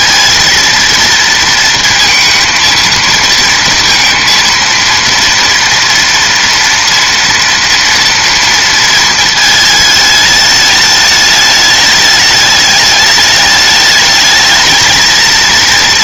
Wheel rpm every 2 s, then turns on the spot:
230, 230, 230, 230, 220, 210, 210, 230.
none